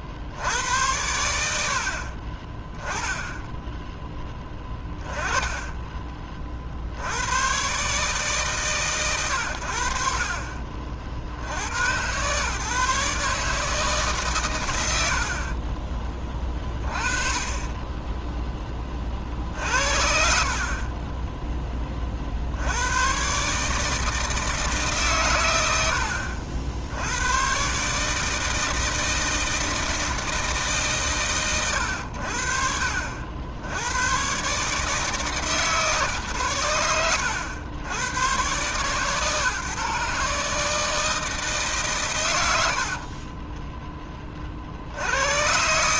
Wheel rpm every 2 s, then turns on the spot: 80, 10, 20, 50, 140, 50, 130, 110, 20, 20, 40, 80, 150, 70, 160, 150, 50, 140, 100, 120, 150, 70, 50.
4-6 20-22 42-44